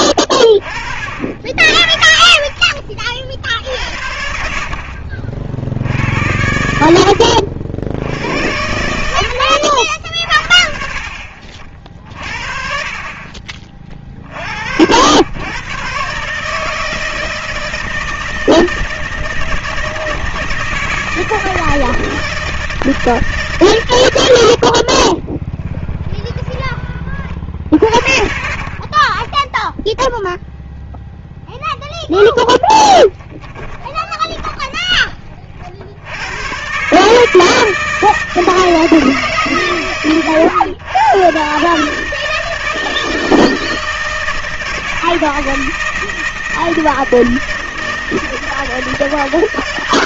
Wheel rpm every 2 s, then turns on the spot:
40, 40, 60, 70, 80, 50, 40, 60, 150, 160, 160, 160, 60, 30, 40, 0, 10, 20, 120, 160, 100, 160, 160, 160, 160.
24-26 32-34